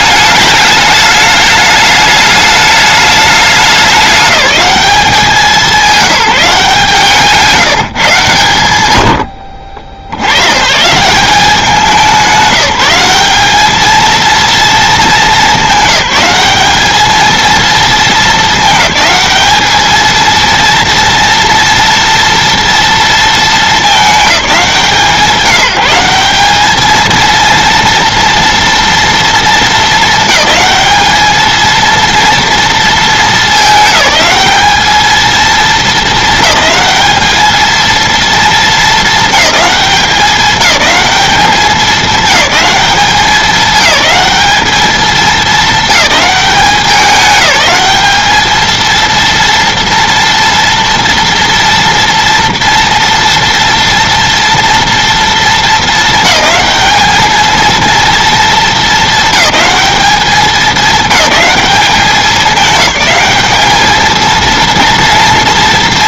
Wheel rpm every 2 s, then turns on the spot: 210, 210, 200, 180, 110, 120, 190, 220, 200, 210, 230, 230, 170, 210, 230, 220, 230, 210, 220, 230, 210, 210, 210, 190, 220, 230, 230, 230, 210, 230, 200, 210, 230.
none